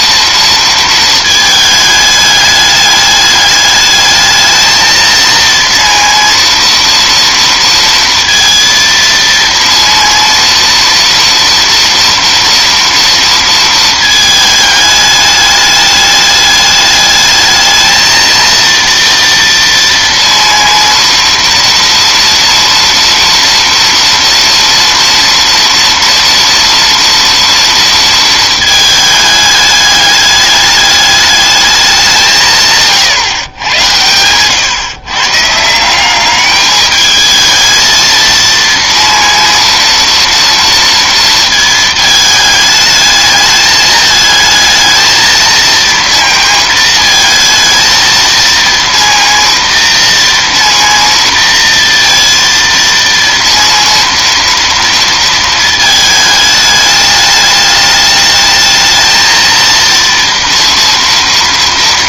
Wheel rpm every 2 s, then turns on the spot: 230, 210, 220, 230, 230, 230, 230, 210, 210, 230, 230, 230, 230, 240, 220, 210, 150, 120, 210, 230, 230, 210, 220, 230, 230, 230, 230, 230, 210, 220, 230.
none